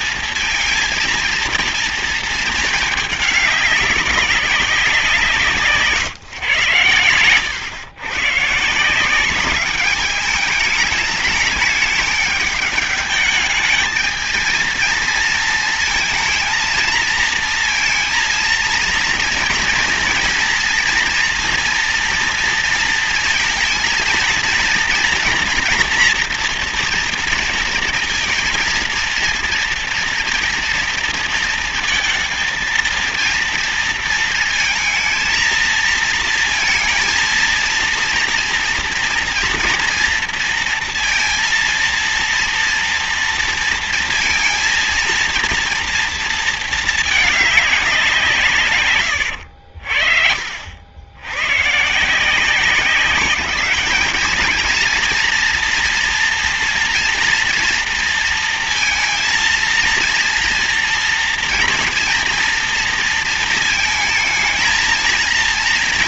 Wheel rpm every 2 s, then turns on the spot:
230, 210, 180, 110, 160, 210, 210, 230, 230, 230, 240, 230, 230, 230, 230, 230, 230, 230, 230, 230, 230, 230, 230, 220, 130, 70, 180, 230, 240, 230, 230, 230, 220.
none